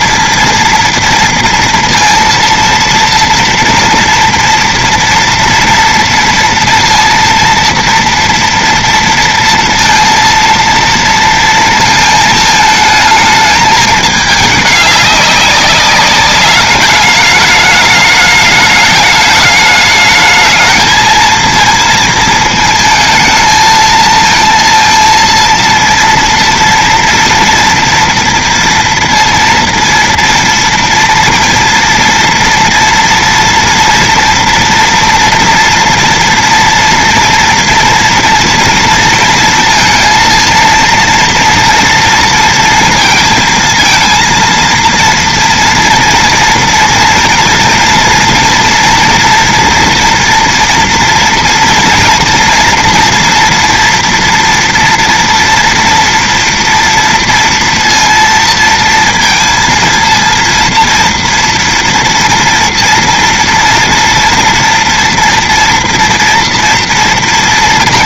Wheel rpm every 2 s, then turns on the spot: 230, 230, 230, 230, 230, 230, 220, 210, 200, 210, 210, 220, 230, 230, 230, 230, 230, 230, 230, 230, 230, 230, 230, 230, 230, 230, 230, 230, 230, 230, 230, 240, 240, 230.
none